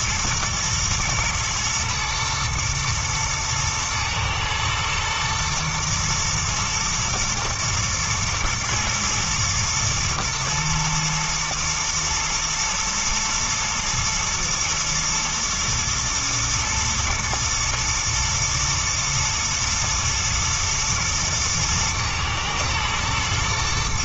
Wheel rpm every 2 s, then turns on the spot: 110, 120, 120, 120, 110, 110, 120, 120, 120, 110, 110, 120.
none